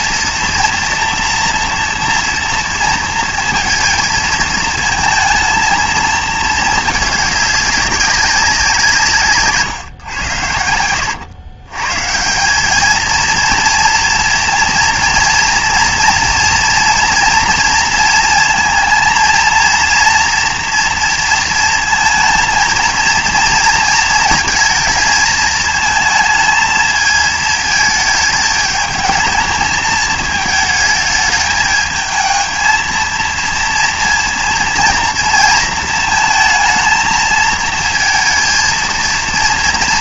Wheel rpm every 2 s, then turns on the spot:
230, 230, 230, 210, 170, 90, 210, 230, 230, 230, 230, 230, 220, 220, 220, 220, 220, 230, 220, 230.
10-12